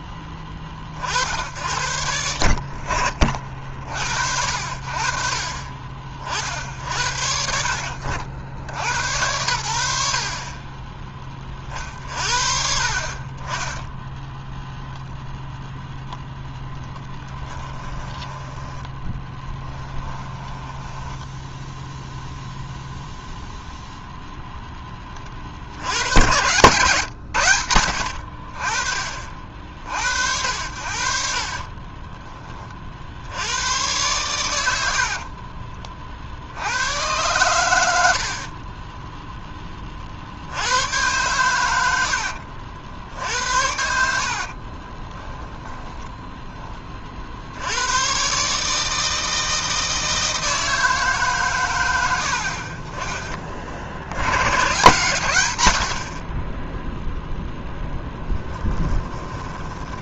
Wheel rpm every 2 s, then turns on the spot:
40, 60, 50, 60, 100, 20, 50, 0, 10, 10, 10, 0, 10, 120, 40, 70, 50, 70, 100, 20, 100, 60, 30, 30, 160, 160, 30, 130, 0, 10.
16-18 20-22 30-32 34-36 38-40 44-46 58-60